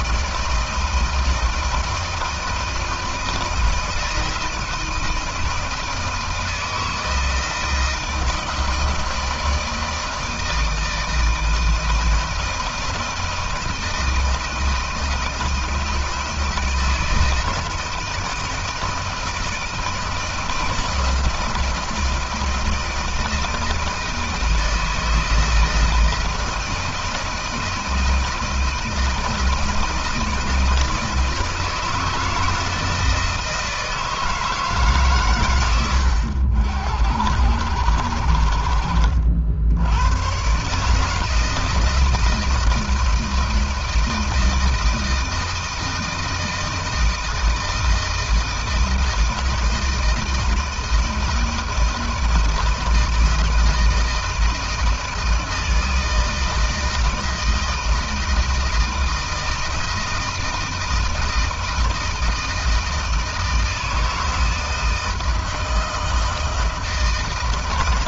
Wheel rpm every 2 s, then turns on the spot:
160, 160, 160, 160, 160, 160, 160, 160, 160, 160, 160, 160, 160, 160, 160, 160, 160, 160, 90, 70, 120, 160, 160, 160, 160, 160, 160, 160, 160, 160, 160, 160, 160, 160.
none